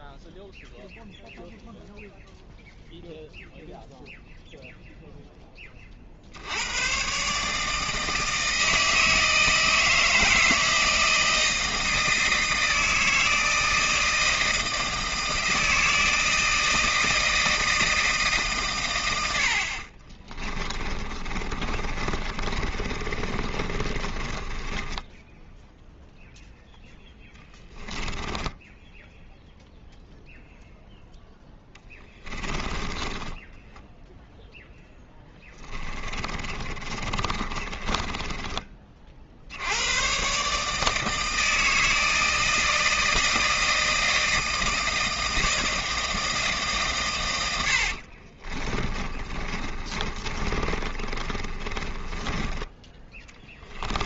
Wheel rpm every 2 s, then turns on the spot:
0, 0, 0, 80, 160, 160, 160, 160, 160, 140, 20, 30, 20, 0, 10, 0, 20, 0, 20, 20, 140, 160, 160, 160, 30, 30, 10.
20-26 28-30 32-34 36-40 48-54